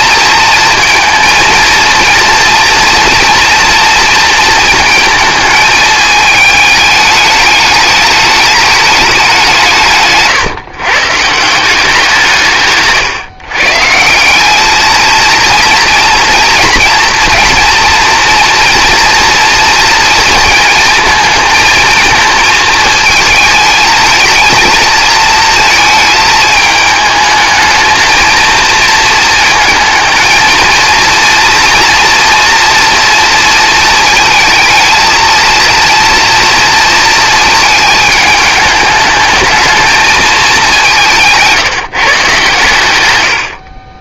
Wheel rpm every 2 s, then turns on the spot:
230, 230, 220, 210, 160, 170, 140, 230, 230, 230, 220, 220, 230, 220, 220, 230, 230, 230, 220, 210, 160, 40.
none